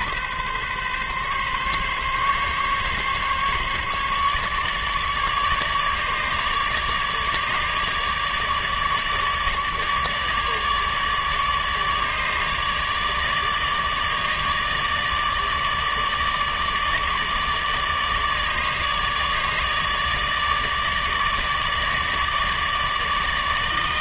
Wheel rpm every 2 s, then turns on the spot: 140, 140, 150, 150, 150, 150, 150, 150, 150, 150, 150, 150.
none